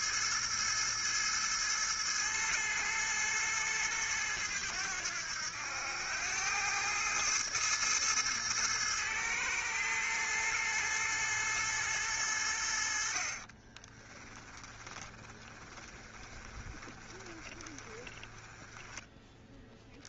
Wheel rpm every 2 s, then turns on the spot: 110, 110, 100, 100, 110, 110, 80, 20, 20, 20.
14-20